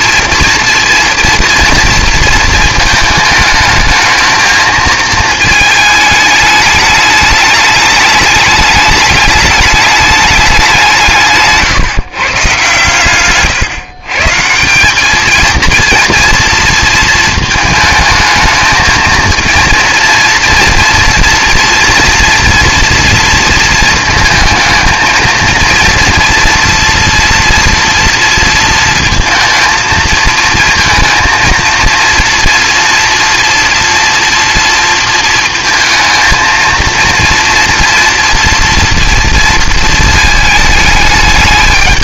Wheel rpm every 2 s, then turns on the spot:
230, 230, 220, 210, 210, 190, 130, 180, 230, 220, 230, 240, 230, 230, 230, 230, 230, 230, 230, 230, 220.
none